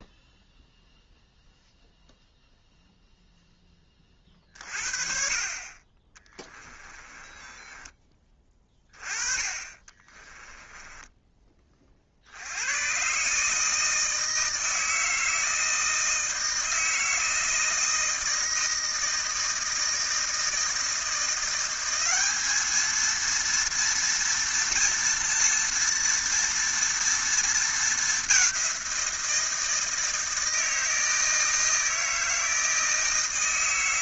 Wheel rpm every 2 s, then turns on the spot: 0, 0, 40, 20, 20, 10, 100, 160, 160, 160, 160, 220, 230, 230, 190, 160, 160.
6-8 10-12